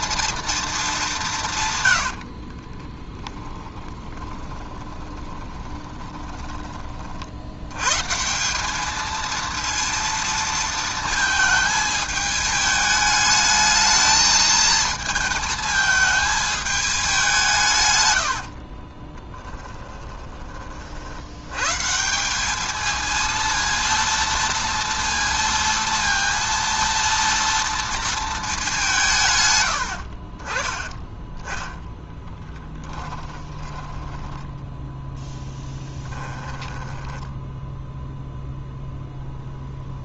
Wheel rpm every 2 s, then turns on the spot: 220, 20, 20, 30, 200, 230, 210, 220, 210, 30, 60, 220, 230, 230, 170, 20, 10, 10, 10, 0.
2-6 18-20 32-34 36-38